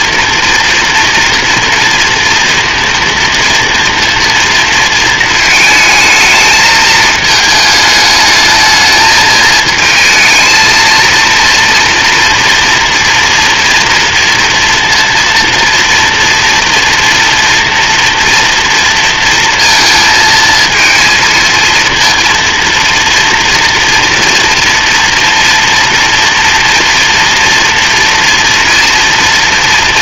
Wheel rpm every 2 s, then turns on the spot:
230, 240, 220, 220, 220, 230, 230, 230, 230, 230, 230, 230, 230, 230, 230.
none